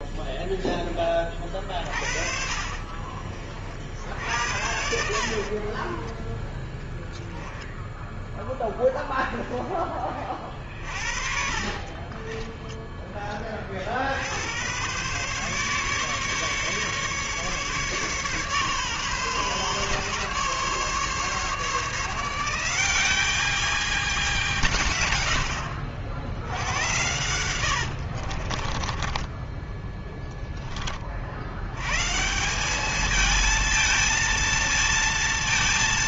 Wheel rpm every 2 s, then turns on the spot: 0, 40, 70, 20, 0, 20, 30, 80, 140, 140, 140, 170, 190, 80, 60, 10, 160, 230.
2-6 12-14 28-30